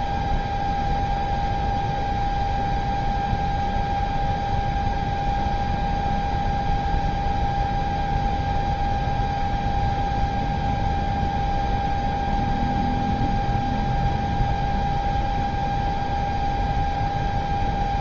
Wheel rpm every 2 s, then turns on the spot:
0, 0, 0, 0, 0, 0, 0, 0, 0.
none